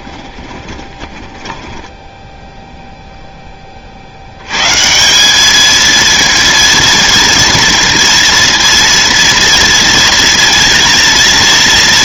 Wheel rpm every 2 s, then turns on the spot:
20, 0, 140, 230, 230, 230.
0-2